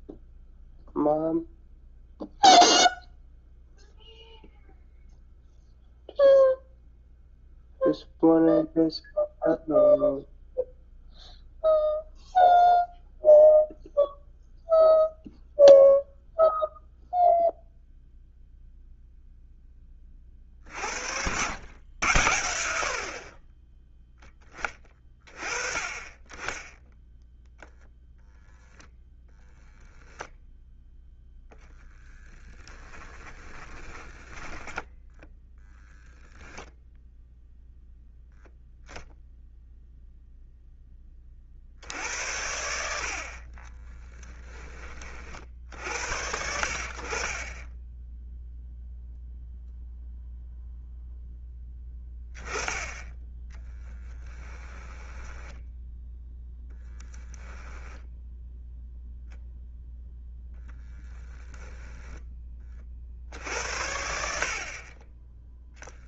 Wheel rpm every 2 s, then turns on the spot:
0, 0, 0, 0, 0, 0, 0, 0, 0, 0, 70, 50, 30, 10, 10, 10, 20, 10, 0, 0, 10, 70, 40, 50, 0, 0, 10, 10, 0, 0, 10, 50, 30.
32-36 54-56 60-62